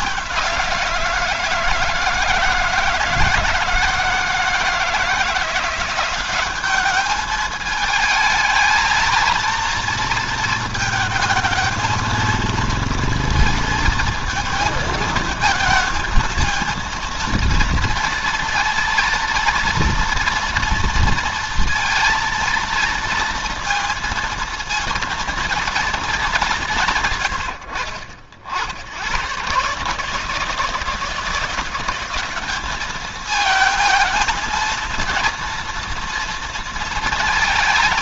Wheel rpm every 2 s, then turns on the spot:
170, 160, 170, 200, 220, 220, 230, 230, 230, 230, 230, 230, 230, 150, 100, 170, 210, 230, 230.
none